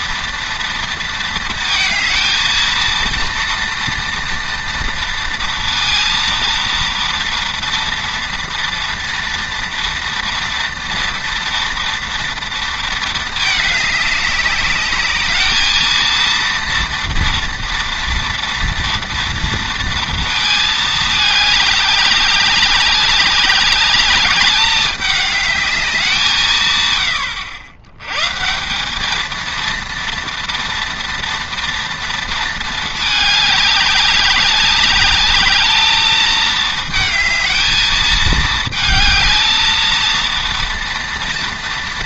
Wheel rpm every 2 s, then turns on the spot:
230, 230, 230, 230, 230, 230, 230, 200, 230, 230, 220, 200, 200, 120, 200, 230, 220, 200, 220, 220, 230.
none